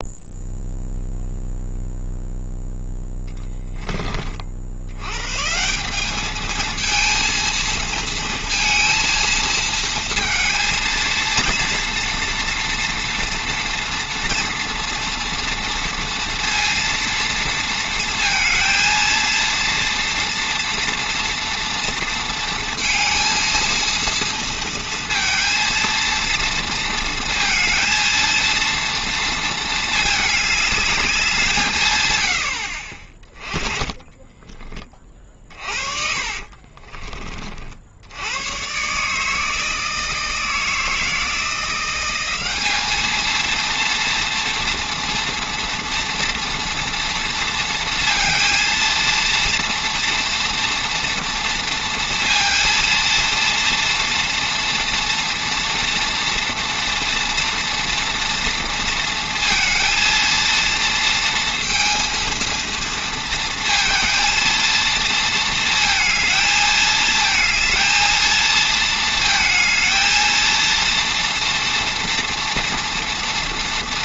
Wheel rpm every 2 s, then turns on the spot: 0, 0, 70, 220, 230, 230, 230, 230, 230, 230, 230, 230, 230, 230, 230, 210, 60, 20, 30, 120, 160, 200, 230, 230, 230, 230, 230, 230, 230, 230, 230, 230, 220, 220, 220, 230, 230.
36-38